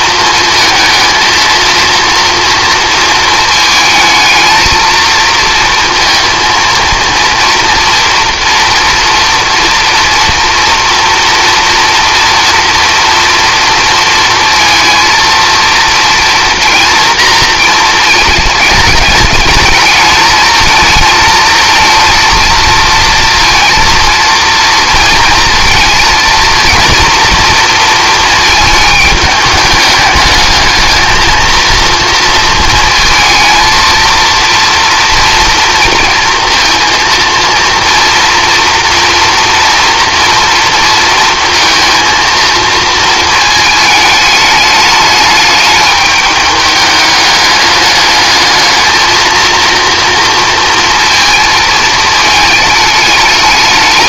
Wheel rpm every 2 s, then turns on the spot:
230, 230, 230, 230, 230, 230, 230, 230, 230, 210, 220, 230, 230, 230, 220, 220, 230, 230, 230, 230, 230, 220, 210, 210, 220, 230, 220.
none